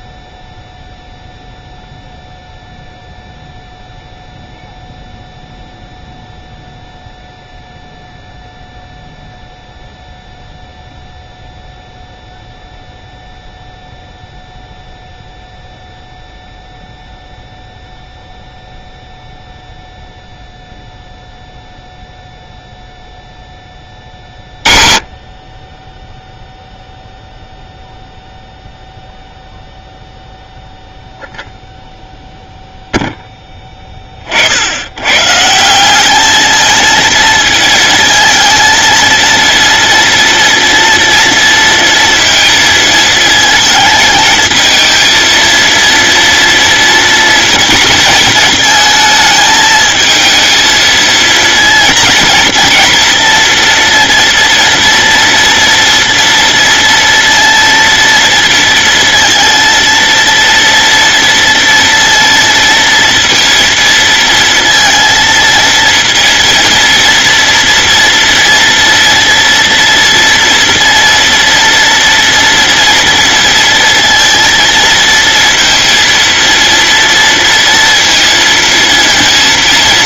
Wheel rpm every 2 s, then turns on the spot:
0, 0, 0, 0, 0, 0, 0, 0, 0, 0, 0, 0, 40, 0, 0, 0, 0, 70, 220, 220, 230, 230, 230, 230, 220, 230, 230, 230, 230, 230, 230, 230, 230, 230, 230, 230, 230, 230, 230, 230.
none